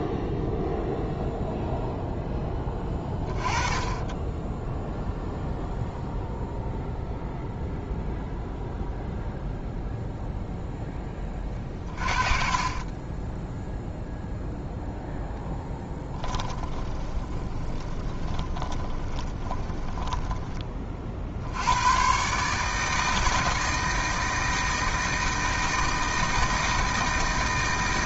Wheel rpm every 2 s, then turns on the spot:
0, 20, 10, 0, 0, 0, 30, 0, 20, 30, 30, 160, 160, 160.
12-14 16-20